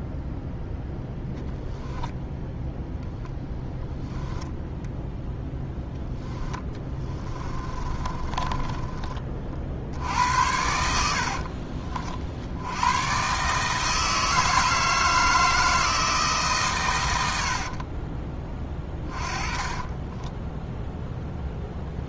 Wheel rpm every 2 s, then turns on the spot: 0, 0, 10, 20, 20, 70, 100, 160, 120, 20, 0.
4-8 18-20